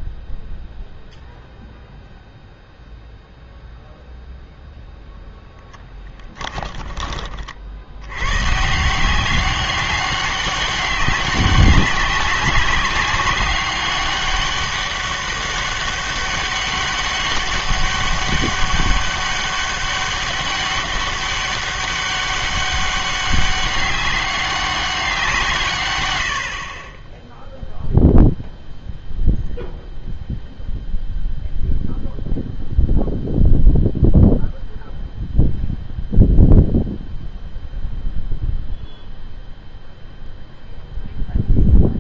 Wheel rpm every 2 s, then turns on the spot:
0, 0, 0, 10, 140, 200, 200, 200, 200, 200, 200, 200, 200, 50, 0, 0, 0, 0, 0, 0, 0.
6-8